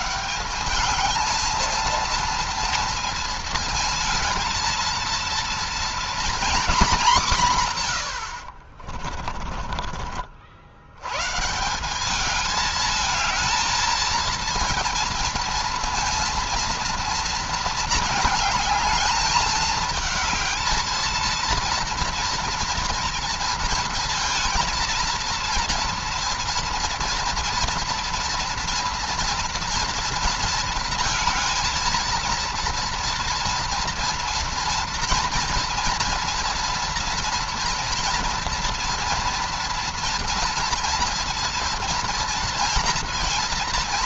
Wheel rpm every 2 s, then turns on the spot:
210, 230, 230, 230, 50, 110, 220, 230, 230, 220, 230, 230, 230, 230, 230, 230, 230, 230, 230, 230, 230, 230.
8-10